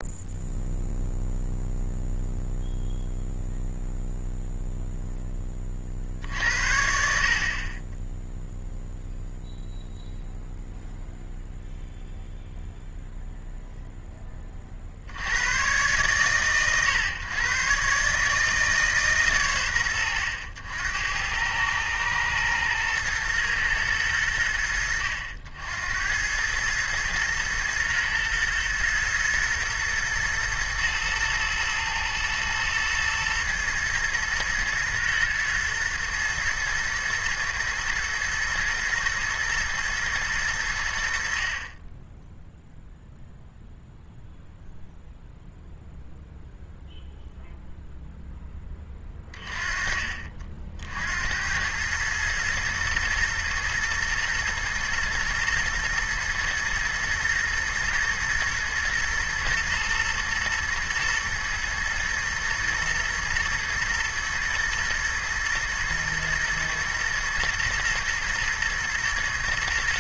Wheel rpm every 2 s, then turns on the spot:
0, 0, 0, 60, 0, 0, 0, 30, 130, 150, 90, 120, 80, 110, 120, 110, 120, 120, 110, 110, 100, 0, 0, 0, 10, 60, 110, 120, 110, 120, 120, 120, 110, 110, 110.
none